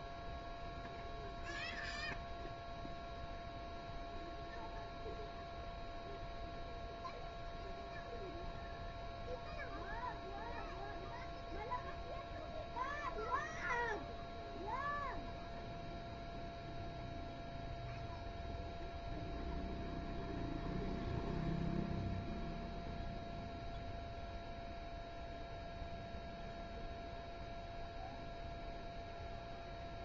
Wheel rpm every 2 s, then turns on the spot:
0, 0, 0, 0, 0, 0, 0, 0, 0, 0, 0, 0, 0, 0, 0.
none